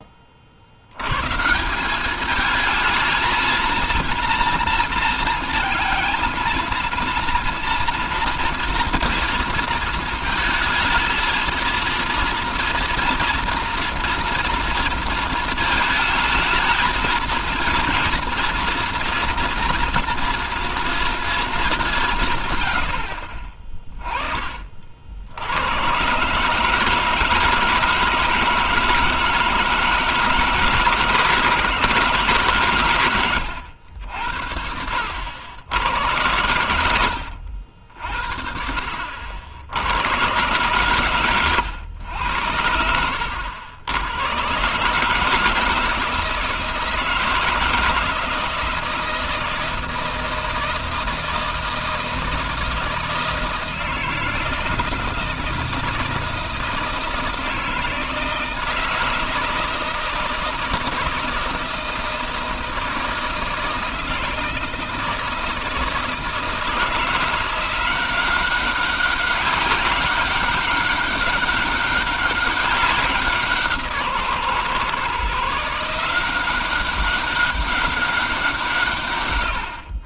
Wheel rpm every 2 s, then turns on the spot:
40, 210, 230, 230, 230, 220, 230, 230, 220, 230, 240, 150, 30, 130, 160, 160, 150, 80, 90, 60, 120, 90, 120, 160, 160, 160, 160, 160, 160, 160, 160, 160, 160, 160, 190, 200, 200, 140, 180, 180.
none